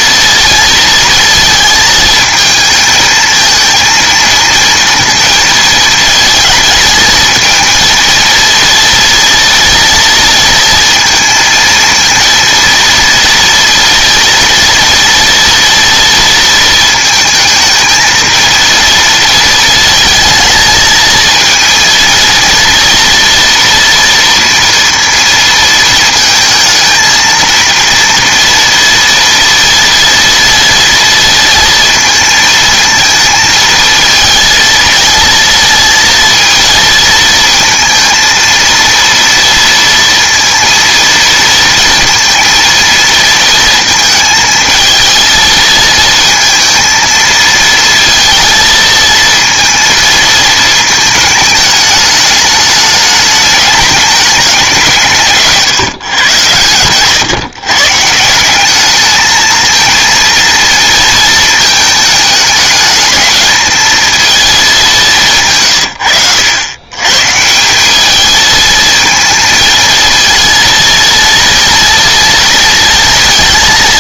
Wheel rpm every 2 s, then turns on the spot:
230, 220, 230, 220, 230, 230, 230, 230, 230, 220, 230, 230, 230, 220, 230, 230, 220, 230, 230, 230, 230, 230, 220, 230, 230, 220, 210, 190, 120, 190, 230, 210, 210, 100, 220, 230, 230.
none